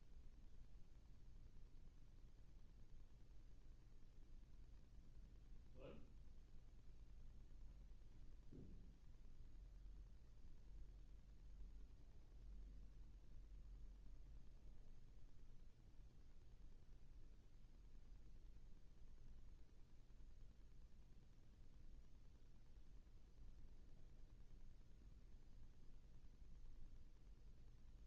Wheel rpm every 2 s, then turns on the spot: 0, 0, 0, 0, 0, 0, 0, 0, 0, 0, 0, 0, 0, 0.
none